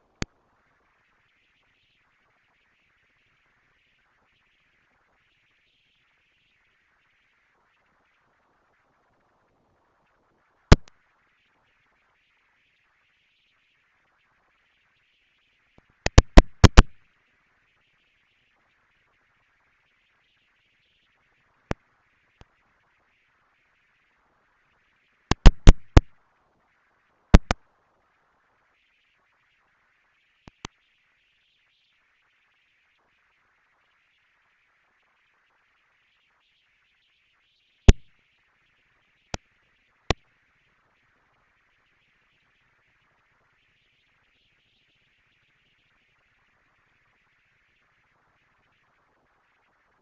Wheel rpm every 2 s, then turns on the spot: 240, 230, 230, 220, 220, 230, 220, 220, 230, 220, 230, 230, 230, 230, 220, 210, 230, 230, 210, 220, 230, 230, 230, 240, 210.
none